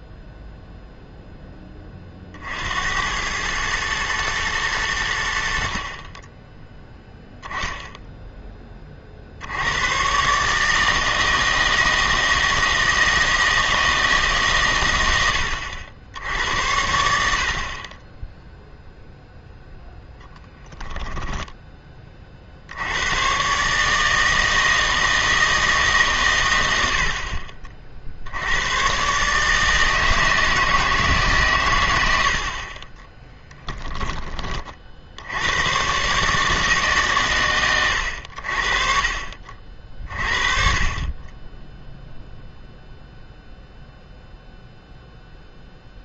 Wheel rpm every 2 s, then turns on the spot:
0, 70, 110, 10, 20, 150, 160, 120, 90, 0, 10, 70, 160, 80, 110, 160, 40, 40, 150, 50, 40, 0, 0.
20-22